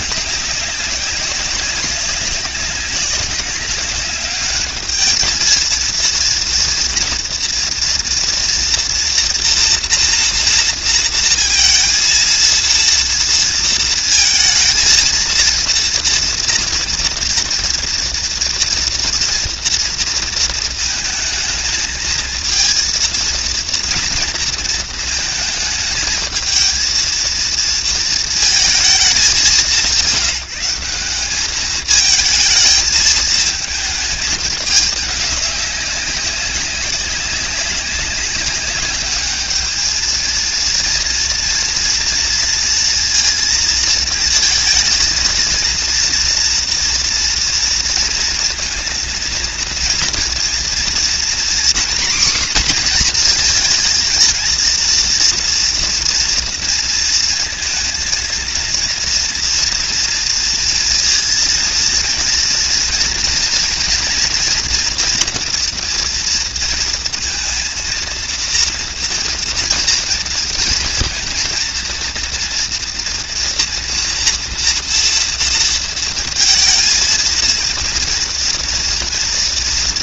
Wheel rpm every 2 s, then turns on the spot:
190, 190, 210, 230, 230, 230, 230, 230, 230, 230, 230, 230, 220, 220, 200, 180, 220, 210, 200, 200, 230, 230, 220, 230, 230, 240, 240, 230, 230, 230, 230, 230, 240, 230, 230, 220, 240, 230, 230, 230.
none